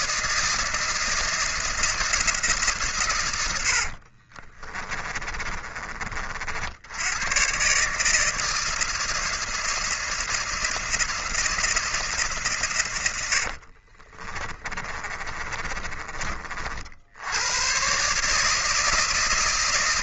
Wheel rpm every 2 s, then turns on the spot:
160, 160, 40, 60, 160, 160, 140, 40, 50, 150.
4-6 14-16